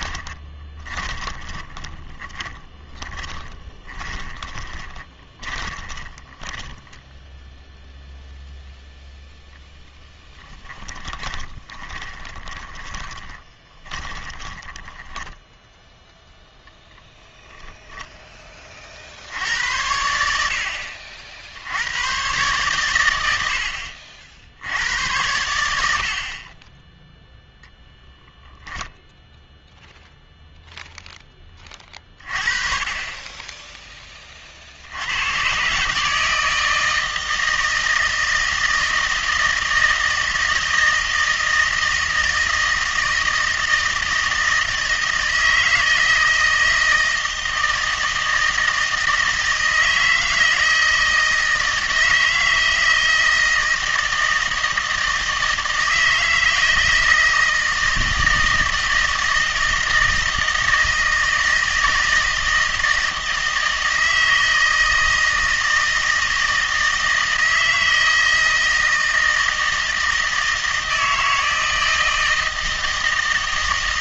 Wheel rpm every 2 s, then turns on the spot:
20, 30, 20, 10, 0, 10, 20, 10, 0, 30, 70, 130, 80, 20, 0, 0, 30, 60, 160, 160, 160, 160, 160, 160, 160, 160, 160, 160, 160, 160, 160, 160, 160, 160, 160, 160, 160.
0-8 10-16